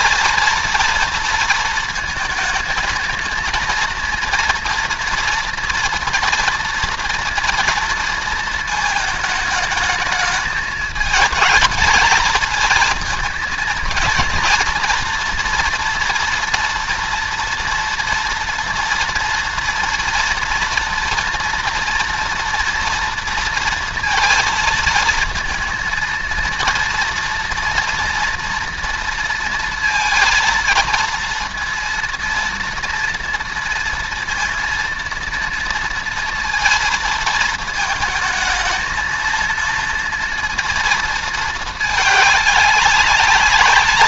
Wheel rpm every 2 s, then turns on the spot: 230, 220, 230, 230, 220, 210, 220, 230, 230, 230, 230, 230, 230, 230, 230, 230, 230, 230, 230, 220, 230, 200.
none